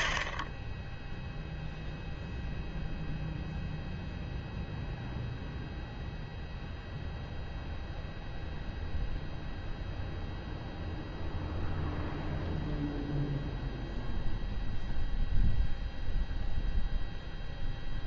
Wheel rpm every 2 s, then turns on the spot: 10, 0, 0, 0, 0, 0, 0, 0, 0.
none